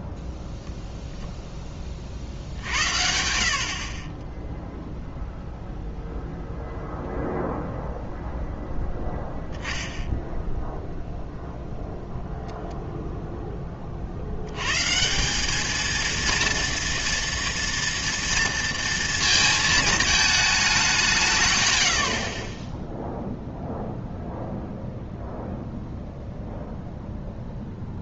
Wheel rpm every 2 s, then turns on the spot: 10, 60, 0, 0, 0, 0, 0, 120, 230, 230, 210, 20, 0, 0.
none